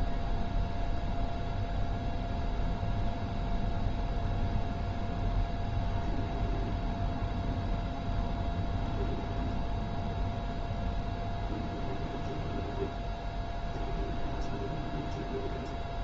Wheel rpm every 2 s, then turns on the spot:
0, 0, 0, 0, 0, 0, 0, 0.
none